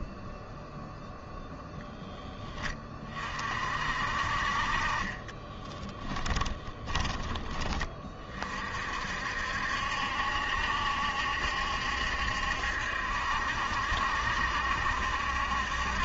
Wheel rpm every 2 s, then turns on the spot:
0, 20, 30, 20, 50, 70, 70, 70.
4-6